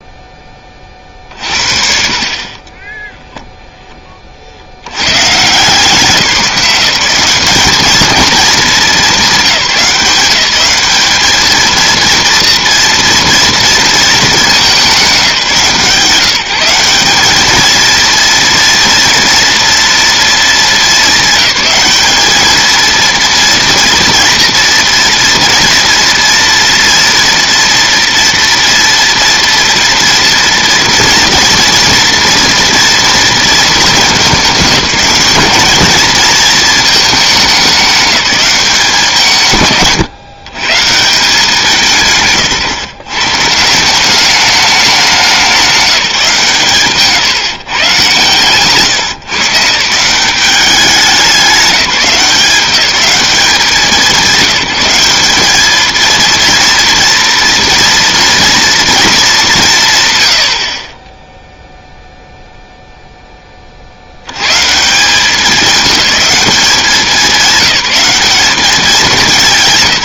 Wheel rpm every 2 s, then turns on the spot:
40, 10, 100, 170, 210, 200, 230, 200, 190, 230, 210, 220, 240, 230, 230, 230, 230, 210, 220, 170, 160, 140, 200, 150, 140, 190, 190, 190, 230, 230, 30, 0, 150, 200, 200.
2-4